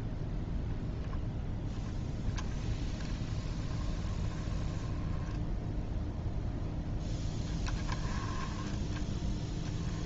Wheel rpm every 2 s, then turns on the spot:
0, 10, 10, 10, 10.
8-10